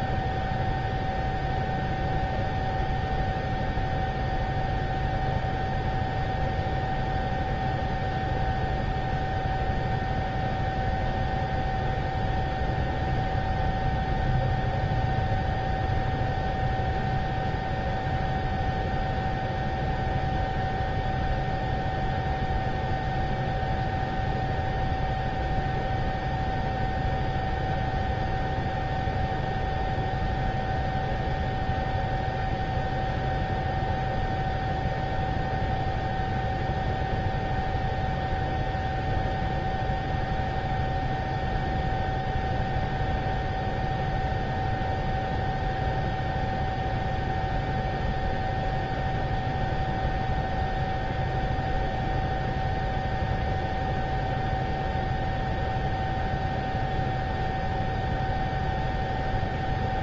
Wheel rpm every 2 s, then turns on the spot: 0, 0, 0, 0, 0, 0, 0, 0, 0, 0, 0, 0, 0, 0, 0, 0, 0, 0, 0, 0, 0, 0, 0, 0, 0, 0, 0, 0, 0, 0.
none